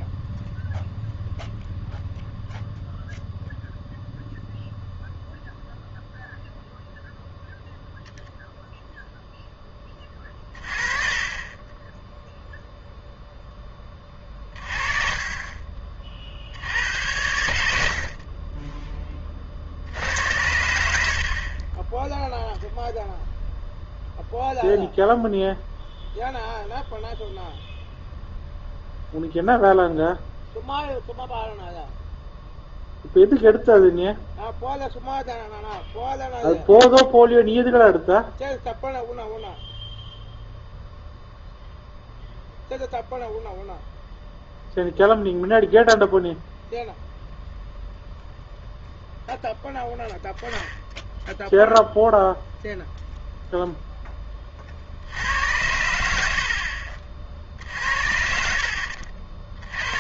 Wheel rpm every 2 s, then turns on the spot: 0, 0, 0, 0, 0, 30, 0, 30, 70, 30, 80, 0, 0, 0, 0, 0, 0, 0, 0, 0, 0, 0, 0, 0, 0, 0, 0, 50, 40, 70.
none